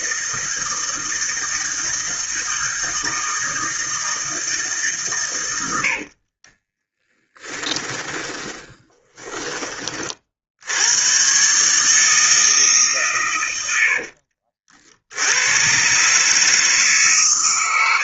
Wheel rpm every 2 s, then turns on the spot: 160, 160, 150, 40, 20, 80, 150, 50, 150.
6-10